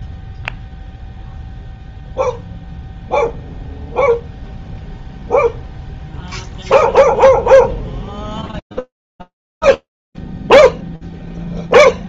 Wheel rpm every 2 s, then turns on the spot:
0, 0, 0, 0, 0, 0.
none